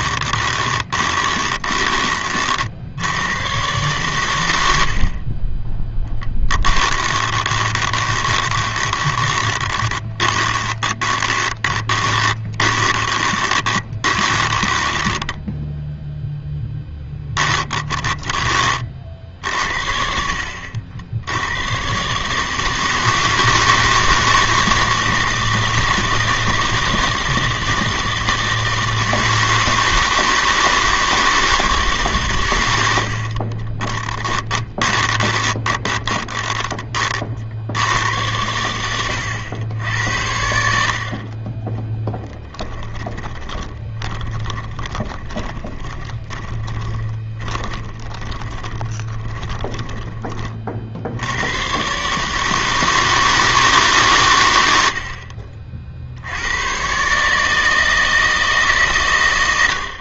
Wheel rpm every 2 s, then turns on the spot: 20, 100, 30, 20, 20, 30, 20, 10, 10, 40, 70, 160, 160, 160, 160, 160, 90, 20, 30, 100, 60, 10, 20, 30, 20, 60, 160, 70, 130, 140.
0-2 6-18 34-36 42-50